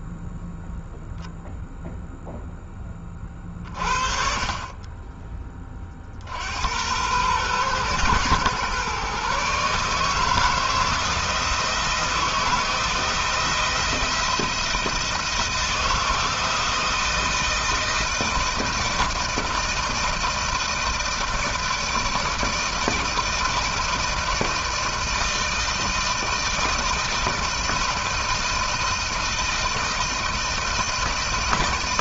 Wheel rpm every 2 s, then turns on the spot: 0, 20, 20, 100, 130, 160, 160, 170, 160, 160, 160, 160, 160, 160, 160, 160.
none